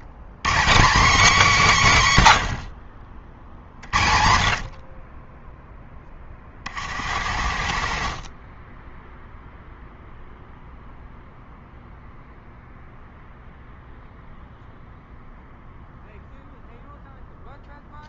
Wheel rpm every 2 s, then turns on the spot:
180, 130, 50, 30, 40, 0, 0, 0, 0.
6-10